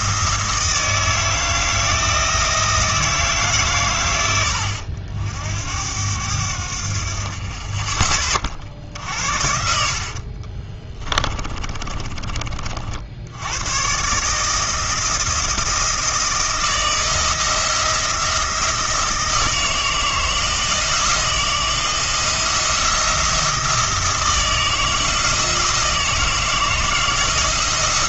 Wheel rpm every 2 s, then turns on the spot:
170, 160, 80, 60, 60, 20, 50, 160, 170, 170, 160, 170, 160, 160.
10-12